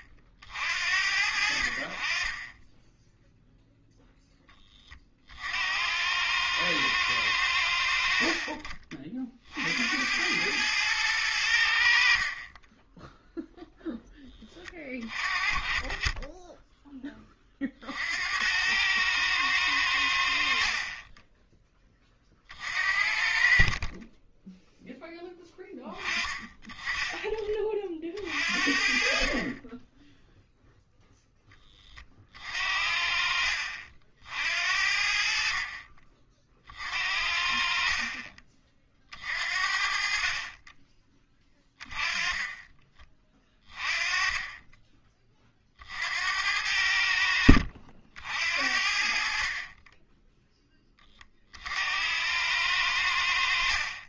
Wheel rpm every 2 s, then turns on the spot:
60, 10, 10, 110, 40, 100, 30, 20, 10, 90, 60, 50, 10, 20, 50, 0, 50, 70, 50, 40, 30, 20, 20, 80, 60, 10, 100.
none